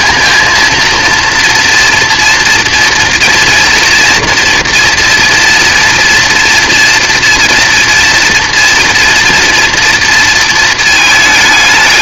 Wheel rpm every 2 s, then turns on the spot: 230, 230, 240, 230, 240, 220.
none